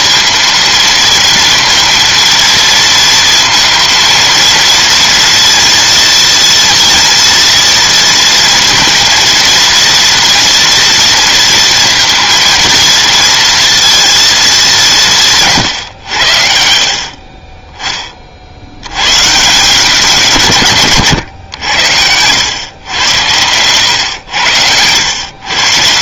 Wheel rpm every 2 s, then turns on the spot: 230, 230, 230, 230, 230, 230, 230, 190, 50, 100, 140, 110, 100.
none